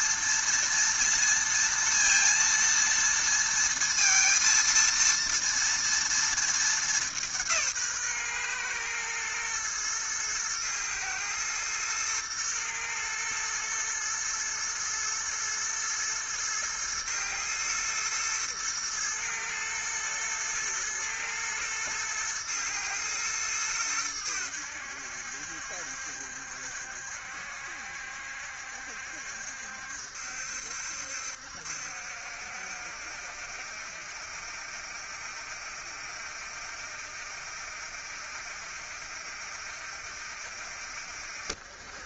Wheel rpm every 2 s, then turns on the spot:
230, 230, 230, 170, 110, 110, 110, 110, 110, 110, 110, 110, 70, 70, 70, 70, 70, 70, 70, 70, 60.
none